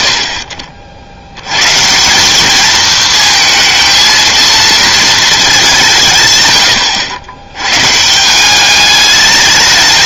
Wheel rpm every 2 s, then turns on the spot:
80, 220, 230, 110, 190.
none